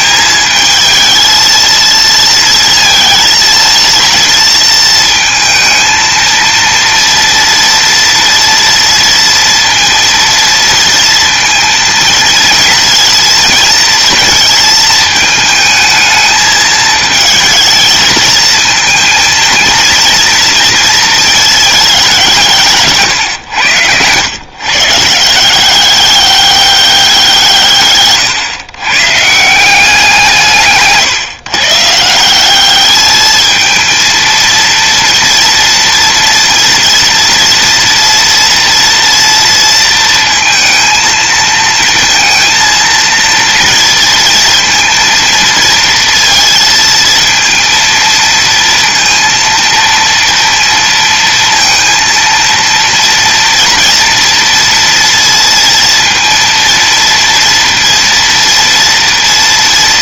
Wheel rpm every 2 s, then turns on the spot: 220, 230, 220, 230, 230, 230, 230, 220, 220, 230, 230, 130, 160, 180, 140, 140, 210, 230, 230, 230, 230, 230, 230, 230, 230, 230, 230, 230, 230, 230.
22-24